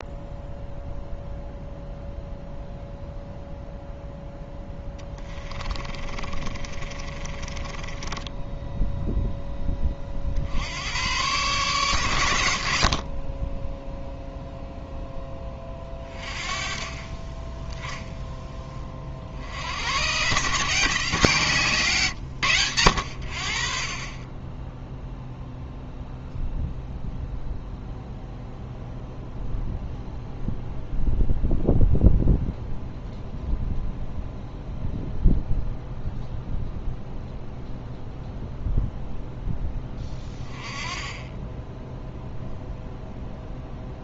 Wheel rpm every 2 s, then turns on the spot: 0, 0, 10, 30, 0, 100, 50, 0, 30, 30, 160, 80, 0, 0, 0, 0, 0, 0, 0, 0, 20, 0.
4-8